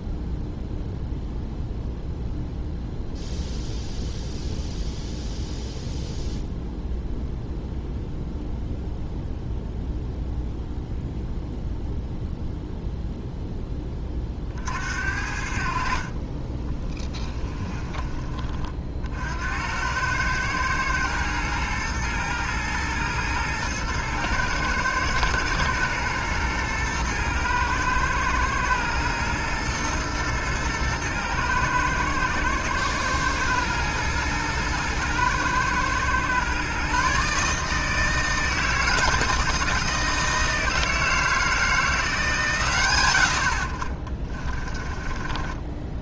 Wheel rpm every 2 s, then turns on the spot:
0, 0, 0, 0, 0, 0, 0, 50, 20, 40, 110, 120, 110, 120, 110, 110, 120, 110, 130, 160, 160, 130, 30.
16-18 44-46